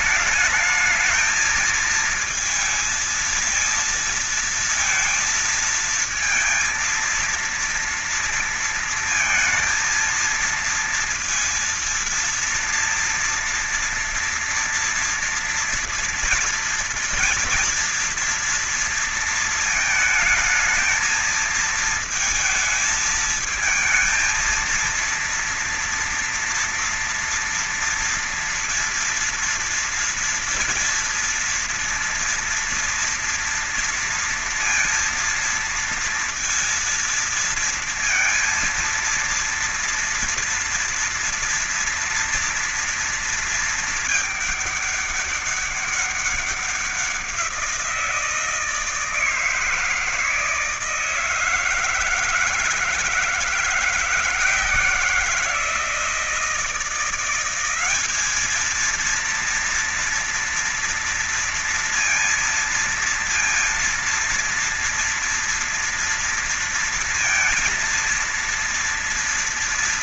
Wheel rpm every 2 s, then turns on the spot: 210, 220, 230, 230, 230, 230, 230, 230, 240, 230, 220, 220, 230, 230, 230, 230, 230, 230, 230, 230, 230, 230, 210, 190, 160, 160, 160, 170, 170, 220, 230, 230, 230, 230, 230.
none